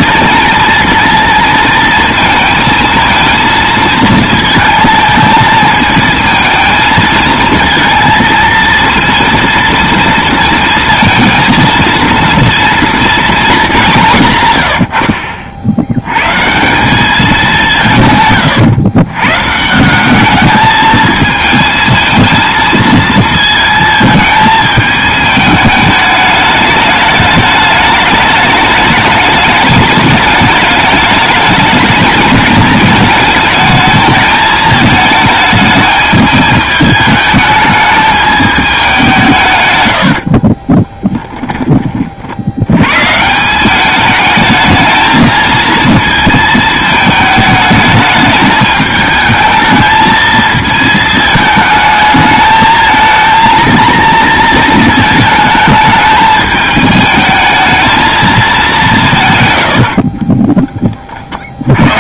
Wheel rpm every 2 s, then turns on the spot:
230, 230, 220, 220, 230, 230, 230, 120, 170, 120, 220, 220, 220, 210, 210, 210, 220, 220, 210, 200, 20, 100, 220, 220, 220, 220, 220, 220, 210, 200, 10.
40-42